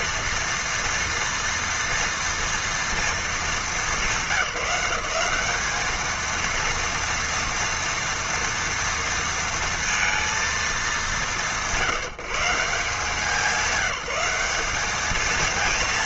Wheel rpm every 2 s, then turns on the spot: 230, 230, 190, 230, 230, 230, 160, 200.
none